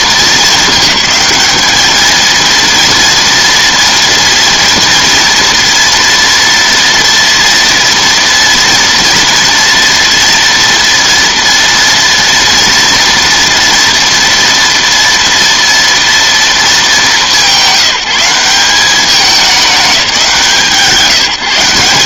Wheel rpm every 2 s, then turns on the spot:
220, 230, 230, 240, 230, 230, 230, 230, 220, 190, 170.
none